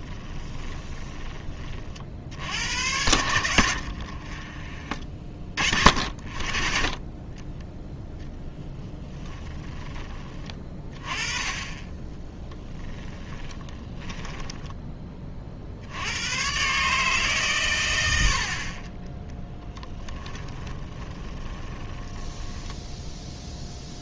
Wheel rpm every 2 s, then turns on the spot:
20, 80, 30, 30, 0, 20, 10, 10, 130, 40, 20, 10.
0-2 12-14 20-24